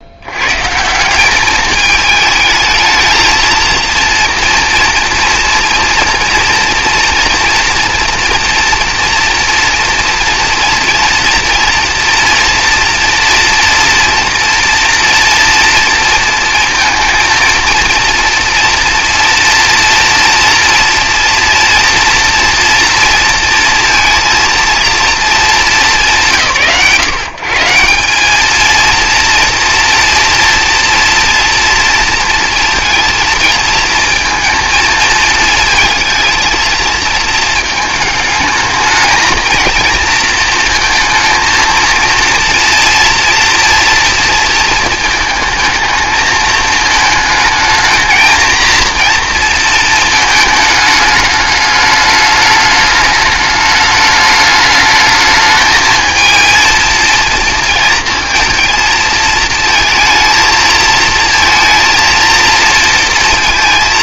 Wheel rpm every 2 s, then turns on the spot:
140, 220, 230, 230, 230, 230, 240, 240, 230, 230, 230, 230, 230, 120, 230, 230, 230, 220, 220, 220, 230, 230, 230, 220, 230, 210, 210, 210, 230, 230, 220, 230.
none